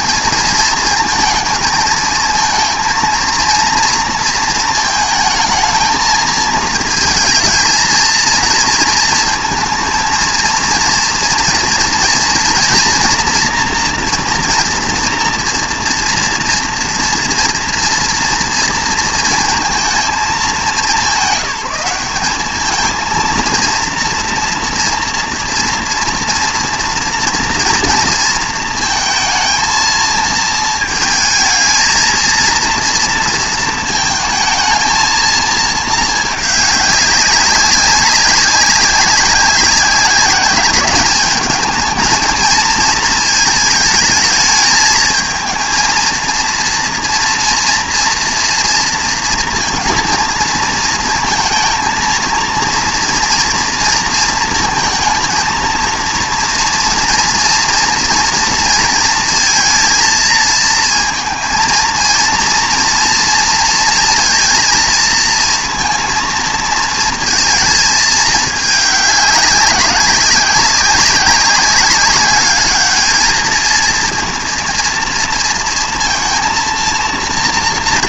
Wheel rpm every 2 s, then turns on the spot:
220, 230, 230, 230, 230, 230, 230, 230, 230, 230, 200, 220, 240, 240, 230, 220, 230, 220, 200, 190, 200, 220, 220, 230, 230, 230, 230, 220, 230, 230, 230, 230, 230, 230, 210, 190, 210, 230, 230.
none